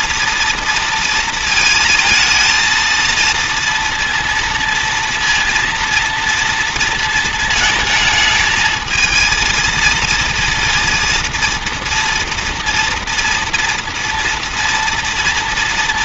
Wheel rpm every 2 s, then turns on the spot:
230, 230, 230, 230, 220, 230, 230, 230.
none